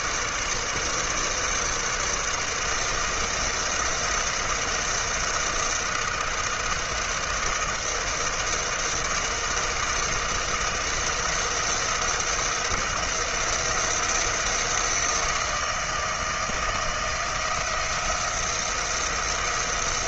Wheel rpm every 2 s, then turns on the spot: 150, 150, 160, 160, 160, 160, 170, 170, 160, 170.
none